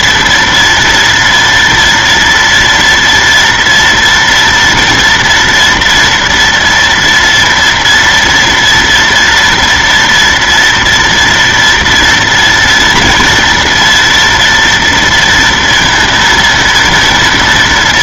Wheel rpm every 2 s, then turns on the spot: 230, 230, 230, 240, 230, 230, 240, 240, 230.
none